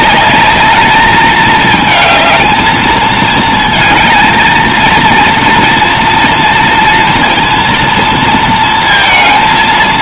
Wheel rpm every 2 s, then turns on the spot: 210, 220, 230, 230, 230.
none